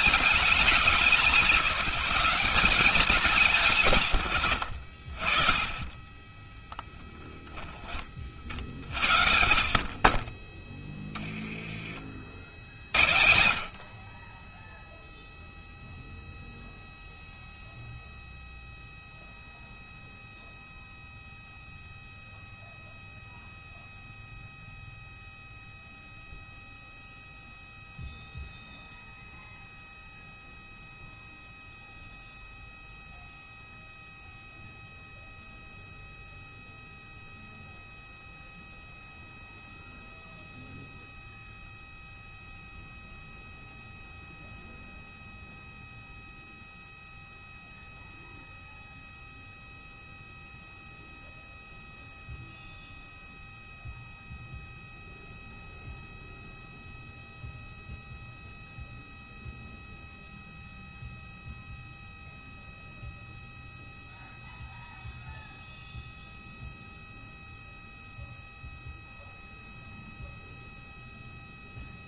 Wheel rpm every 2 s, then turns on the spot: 210, 200, 90, 10, 40, 20, 60, 20, 0, 0, 0, 0, 0, 0, 0, 0, 0, 0, 0, 0, 0, 0, 0, 0, 0, 0, 0, 0, 0, 0, 0, 0, 0, 0, 0, 0.
6-8